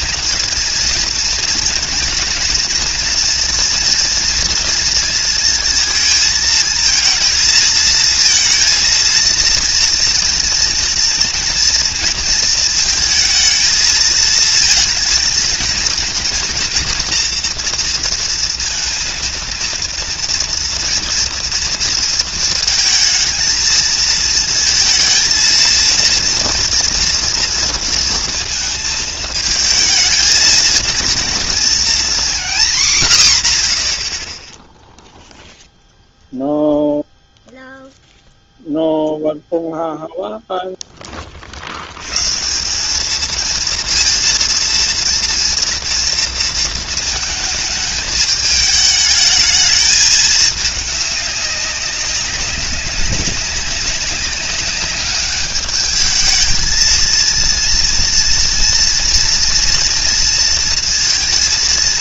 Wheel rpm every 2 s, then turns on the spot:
230, 230, 230, 220, 230, 230, 230, 230, 230, 230, 230, 220, 230, 230, 220, 220, 230, 10, 0, 0, 0, 160, 230, 230, 210, 210, 200, 200, 220, 230, 230.
none